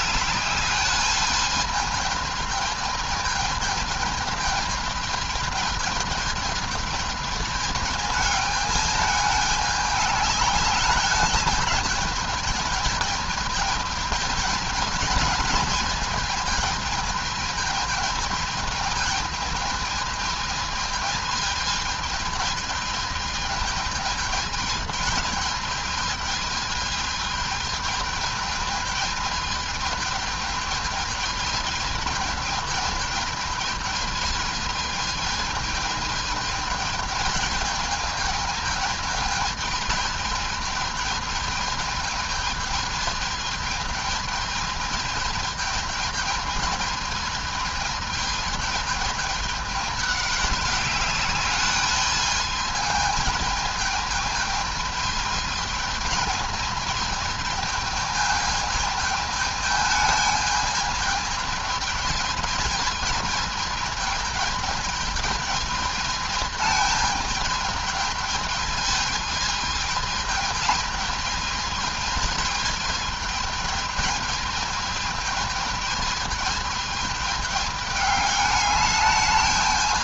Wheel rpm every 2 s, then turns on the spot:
200, 220, 220, 220, 210, 210, 210, 210, 220, 220, 220, 220, 220, 220, 220, 210, 220, 220, 220, 220, 220, 220, 220, 220, 210, 200, 220, 220, 220, 210, 220, 220, 220, 220, 210, 220, 220, 220, 220, 210.
none